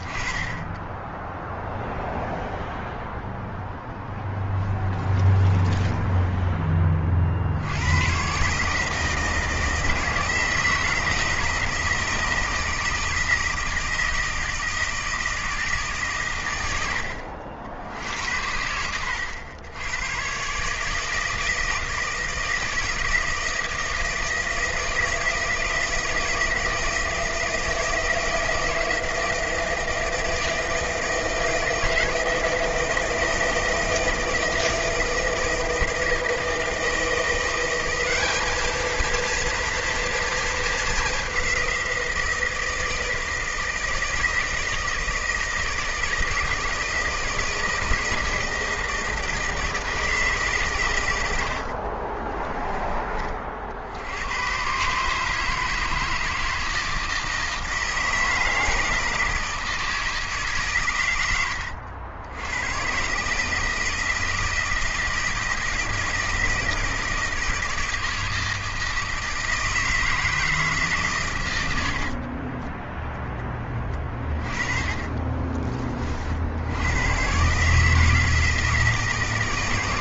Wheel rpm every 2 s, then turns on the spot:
20, 0, 0, 10, 140, 160, 160, 160, 100, 80, 150, 160, 160, 160, 160, 160, 160, 160, 160, 210, 220, 170, 160, 160, 160, 140, 20, 120, 160, 160, 140, 100, 160, 160, 160, 150, 20, 30, 80, 160.
72-76